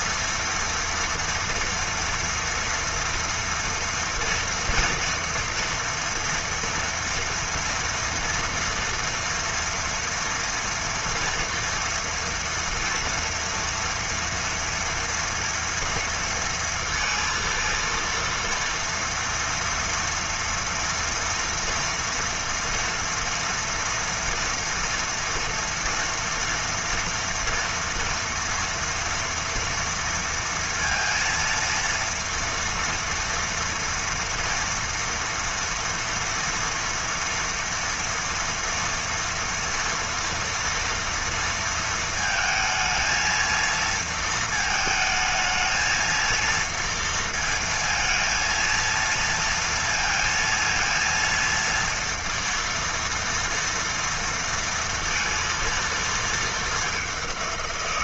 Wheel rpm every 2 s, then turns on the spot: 230, 230, 230, 240, 230, 230, 230, 240, 230, 230, 240, 230, 230, 230, 230, 230, 230, 230, 230, 230, 230, 220, 220, 230, 230, 230, 230, 230, 210.
none